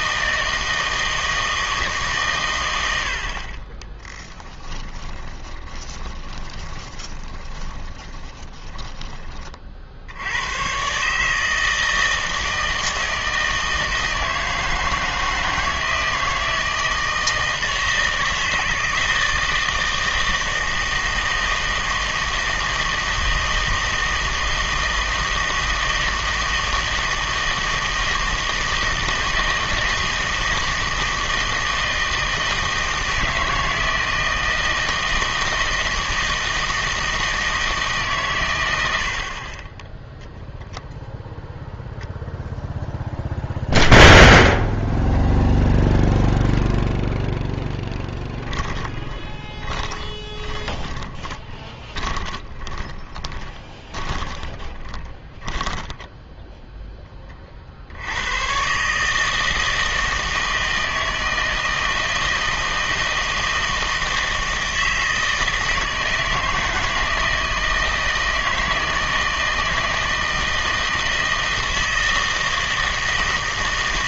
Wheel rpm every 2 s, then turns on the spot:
160, 110, 10, 20, 30, 110, 160, 160, 160, 160, 160, 160, 160, 160, 160, 160, 160, 160, 160, 100, 0, 0, 0, 0, 20, 20, 20, 20, 10, 130, 160, 160, 160, 160, 160, 160, 160.
4-10 48-56